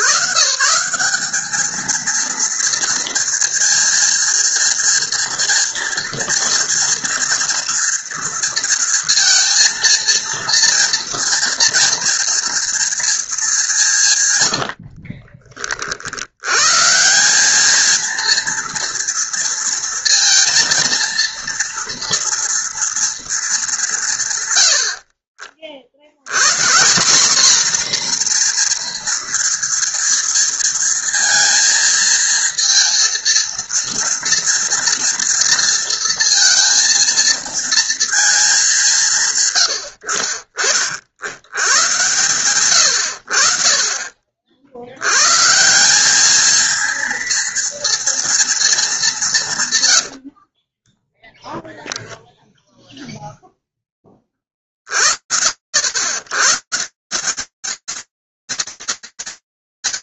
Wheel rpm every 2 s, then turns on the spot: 150, 230, 230, 230, 230, 230, 230, 150, 60, 230, 230, 230, 180, 90, 240, 230, 230, 230, 230, 230, 60, 120, 50, 200, 230, 100, 0, 20, 120, 50.
40-42 50-52